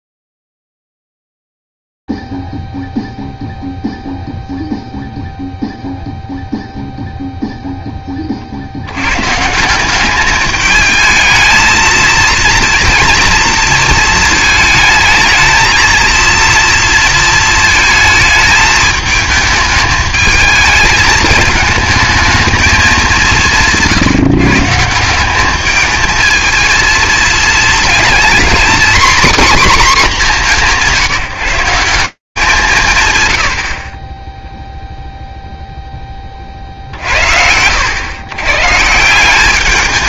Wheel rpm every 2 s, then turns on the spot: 0, 0, 0, 0, 10, 180, 230, 230, 220, 220, 210, 220, 160, 210, 230, 250, 180, 30, 20, 110.
none